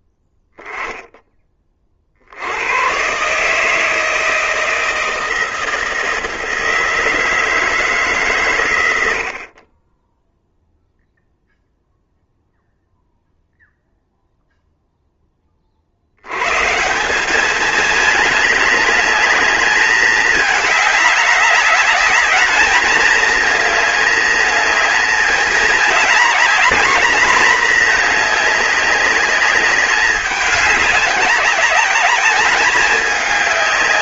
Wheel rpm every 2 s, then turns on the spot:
10, 100, 160, 160, 110, 0, 0, 0, 150, 210, 210, 210, 220, 220, 200, 200, 200.
none